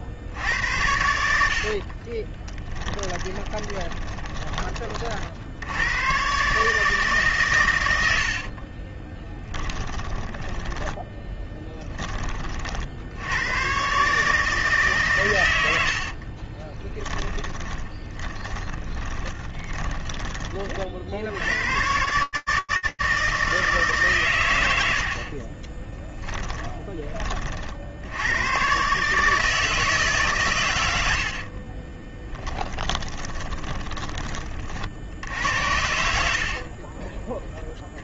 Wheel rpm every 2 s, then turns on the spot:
70, 30, 20, 130, 70, 10, 30, 140, 60, 10, 30, 120, 120, 20, 110, 140, 10, 40, 40.
2-6 8-12 16-22 26-28 32-34 36-38